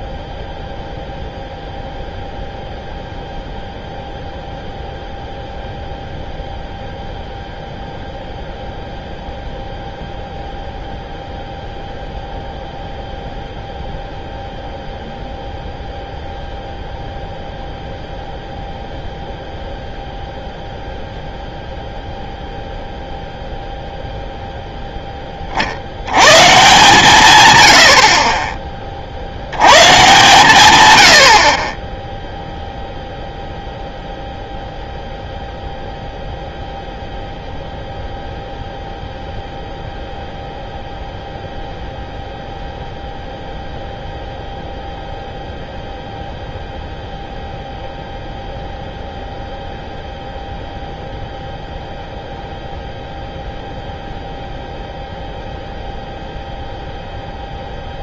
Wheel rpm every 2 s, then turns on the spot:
0, 0, 0, 0, 0, 0, 0, 0, 0, 0, 0, 0, 0, 140, 30, 120, 0, 0, 0, 0, 0, 0, 0, 0, 0, 0, 0, 0, 0.
none